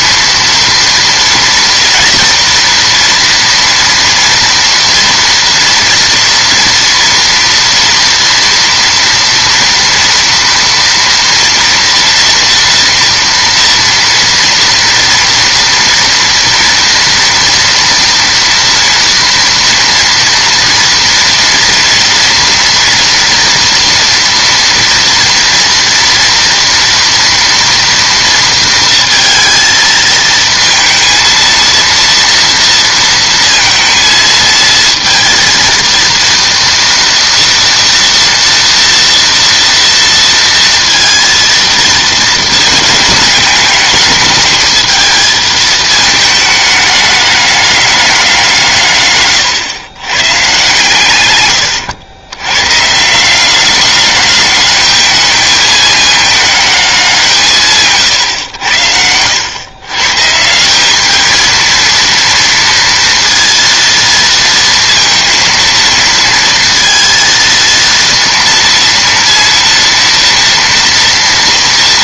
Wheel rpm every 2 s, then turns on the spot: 230, 240, 230, 230, 230, 230, 230, 230, 230, 240, 230, 240, 230, 230, 230, 230, 230, 230, 230, 230, 230, 220, 220, 210, 140, 140, 130, 210, 200, 90, 180, 230, 230, 230, 230, 230.
none